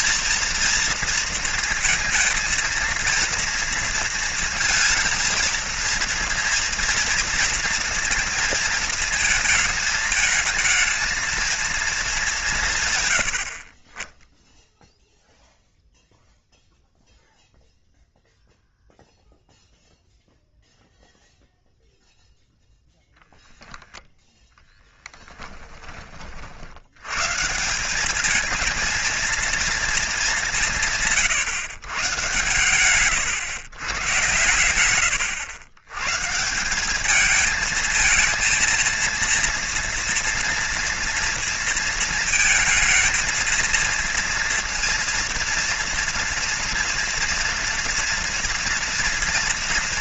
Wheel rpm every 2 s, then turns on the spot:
230, 230, 230, 230, 220, 220, 140, 0, 0, 0, 0, 0, 10, 90, 220, 160, 110, 100, 190, 230, 230, 230, 230, 230, 230.
24-26